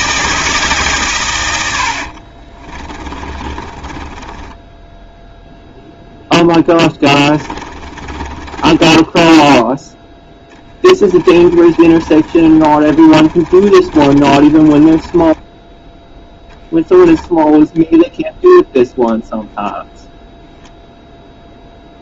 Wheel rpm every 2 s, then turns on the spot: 150, 30, 10, 10, 20, 10, 30, 20, 10, 0, 0.
2-18